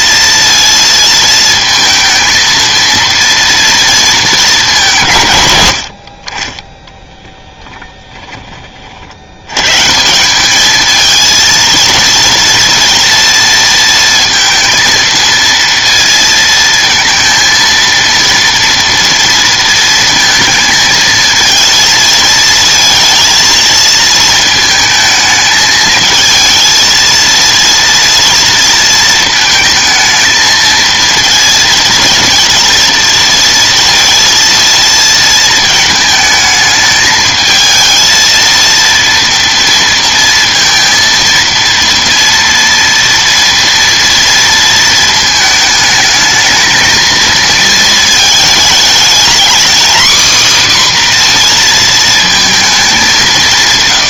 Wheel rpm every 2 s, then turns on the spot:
230, 230, 200, 20, 20, 210, 230, 230, 230, 230, 220, 220, 220, 220, 230, 230, 230, 230, 220, 230, 230, 230, 230, 220, 220, 270, 220.
none